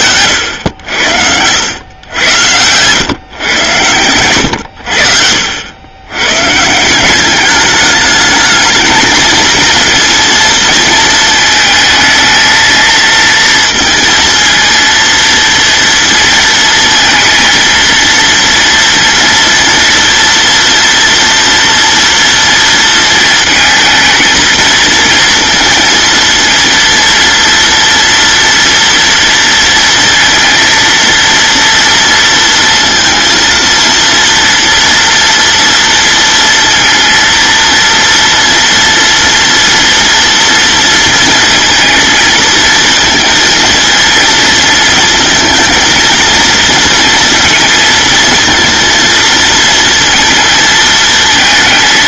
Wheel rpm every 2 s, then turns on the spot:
80, 120, 80, 180, 220, 230, 230, 230, 230, 230, 230, 230, 230, 230, 230, 230, 230, 230, 230, 230, 230, 220, 220, 230, 230, 220.
none